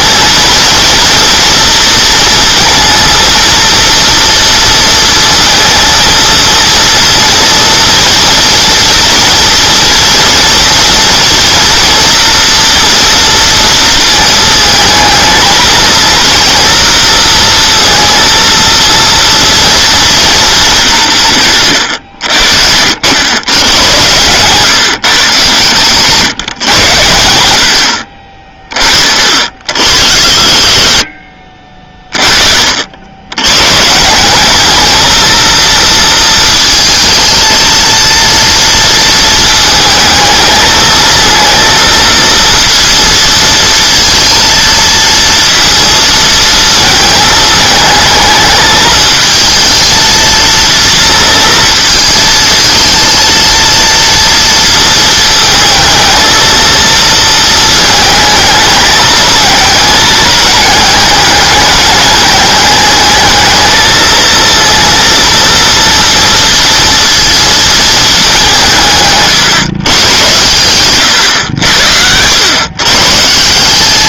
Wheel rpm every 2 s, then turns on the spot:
230, 230, 230, 230, 230, 230, 230, 220, 230, 230, 190, 70, 140, 110, 40, 50, 60, 210, 220, 230, 220, 230, 230, 220, 220, 230, 220, 230, 230, 210, 210, 210, 230, 230, 170, 110, 130.
70-72